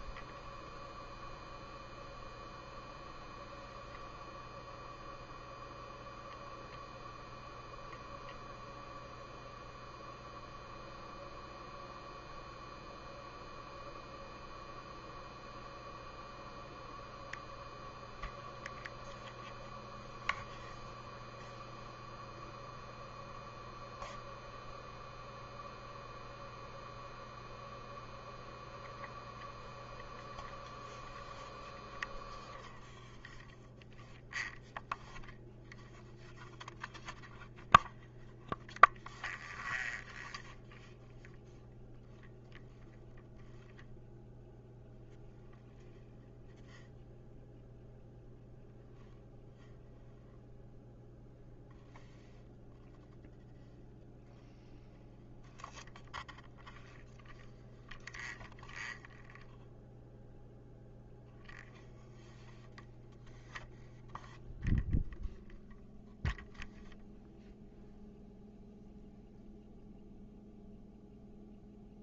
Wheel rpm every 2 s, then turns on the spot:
0, 0, 0, 0, 0, 0, 0, 0, 0, 0, 0, 0, 0, 0, 0, 0, 0, 0, 0, 0, 0, 0, 0, 0, 0, 0, 0, 0, 0, 0, 0, 0, 0, 0, 0, 0.
none